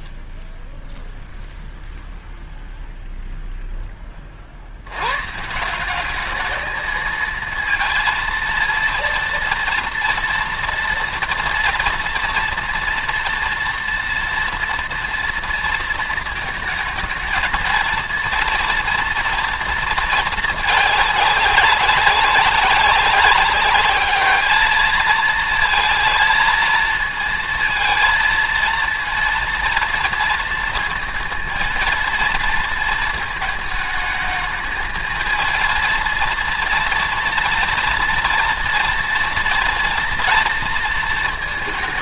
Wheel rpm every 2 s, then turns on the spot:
0, 0, 70, 210, 230, 230, 230, 230, 220, 230, 210, 190, 220, 230, 230, 230, 230, 220, 230, 230, 230.
none